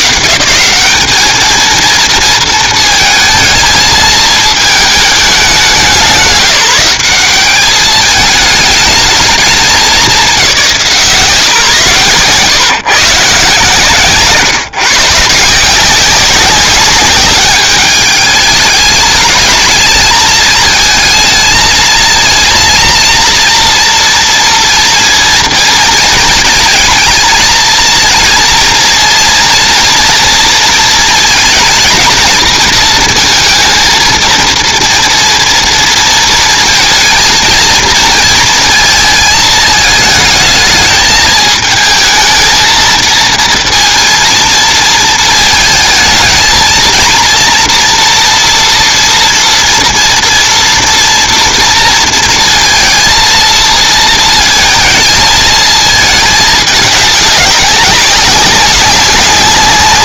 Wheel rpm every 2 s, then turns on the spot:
190, 230, 220, 190, 220, 200, 140, 150, 200, 200, 220, 230, 230, 220, 230, 220, 220, 230, 230, 220, 220, 230, 230, 230, 240, 230, 230, 230, 210, 190.
none